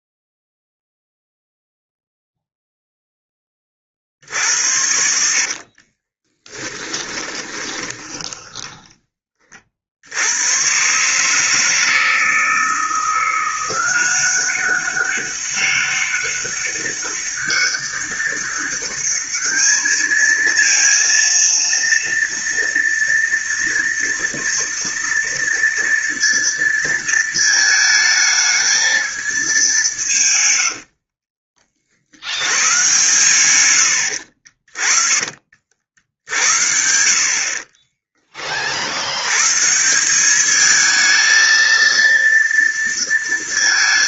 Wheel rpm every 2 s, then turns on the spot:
0, 0, 70, 20, 10, 110, 160, 190, 200, 200, 220, 230, 230, 230, 220, 120, 100, 50, 60, 40, 210, 230.
6-10 30-32 34-38